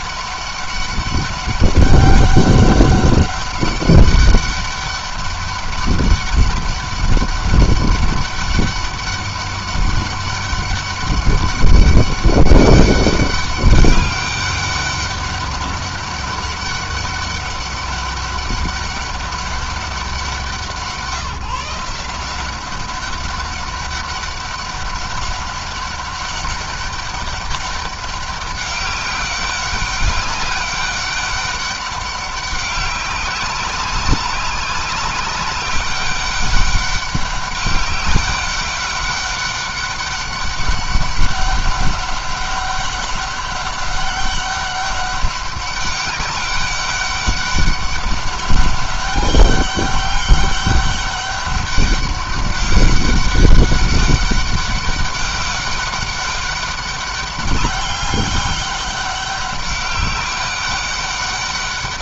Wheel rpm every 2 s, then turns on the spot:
200, 200, 200, 200, 200, 200, 200, 200, 200, 200, 180, 190, 200, 200, 200, 200, 200, 190, 200, 200, 200, 200, 200, 200, 200, 200, 200, 200, 200, 200, 200.
none